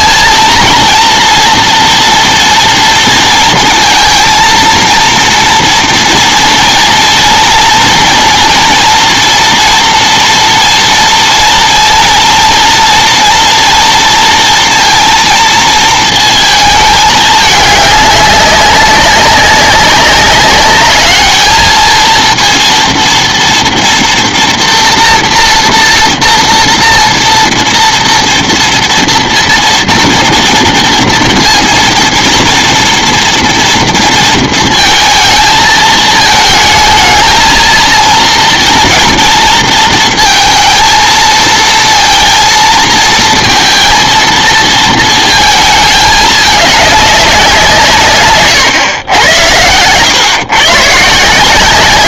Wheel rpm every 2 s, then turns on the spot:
230, 230, 230, 230, 230, 230, 230, 230, 220, 200, 200, 230, 230, 230, 230, 230, 230, 230, 220, 230, 230, 230, 220, 210, 120, 130.
none